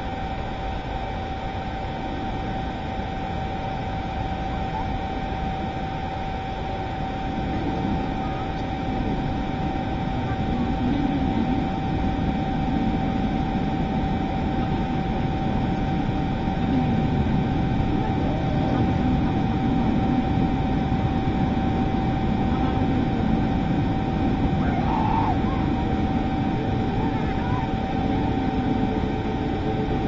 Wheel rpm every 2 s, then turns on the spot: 0, 0, 0, 0, 0, 0, 0, 0, 0, 0, 0, 0, 0, 0, 0.
none